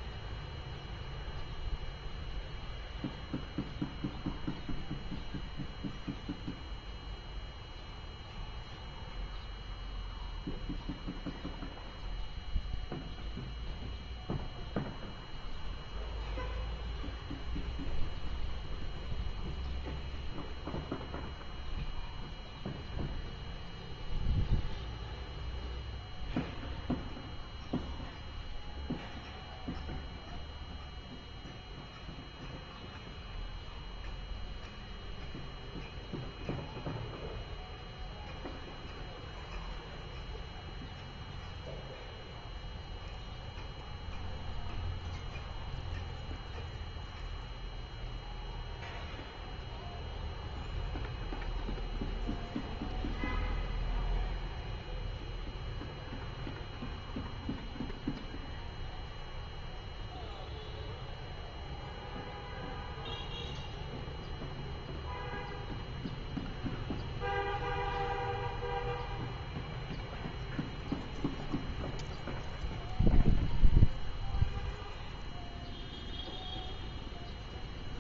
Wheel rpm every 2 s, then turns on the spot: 0, 0, 0, 0, 0, 0, 0, 0, 0, 0, 0, 0, 0, 0, 0, 0, 0, 0, 0, 0, 0, 0, 0, 0, 0, 0, 0, 0, 0, 0, 0, 0, 0, 0, 0, 0, 0, 0, 0.
none